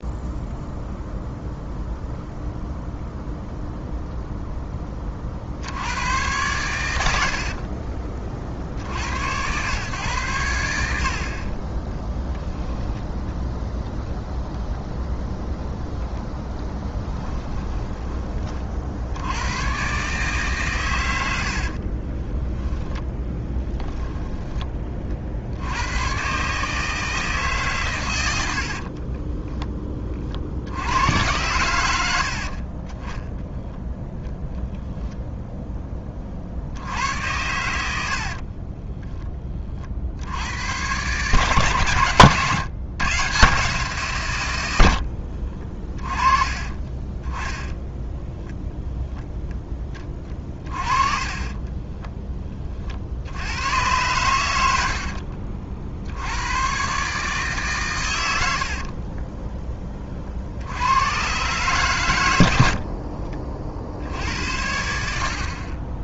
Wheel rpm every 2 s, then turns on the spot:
0, 0, 10, 110, 50, 80, 10, 0, 10, 50, 130, 10, 10, 140, 70, 70, 50, 0, 70, 30, 90, 130, 90, 30, 0, 30, 30, 80, 110, 60, 80, 70, 80.
16-18 22-24 38-40 46-48 50-52 54-56 58-60